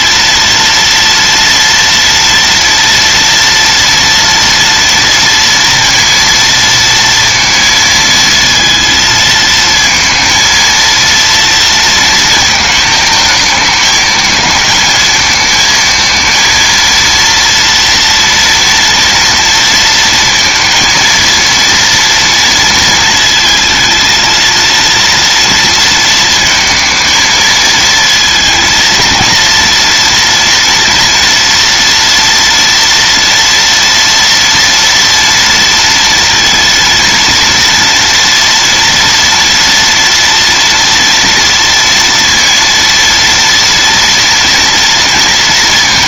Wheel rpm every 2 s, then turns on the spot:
230, 230, 230, 230, 230, 230, 220, 220, 230, 230, 230, 230, 230, 220, 230, 230, 230, 230, 230, 230, 230, 230, 230.
none